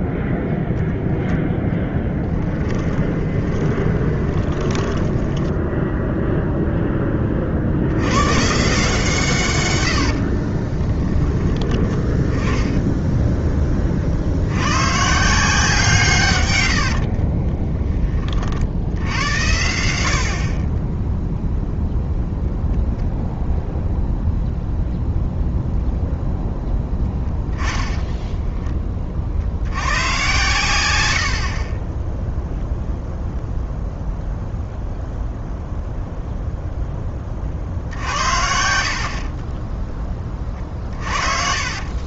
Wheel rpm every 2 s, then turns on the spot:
0, 20, 10, 10, 150, 20, 10, 110, 90, 70, 20, 0, 0, 0, 10, 110, 0, 0, 0, 60, 40.
2-6 10-14 16-18 38-42